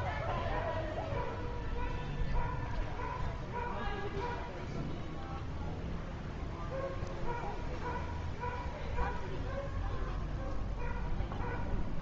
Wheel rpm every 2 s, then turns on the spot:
0, 0, 0, 0, 0, 0.
none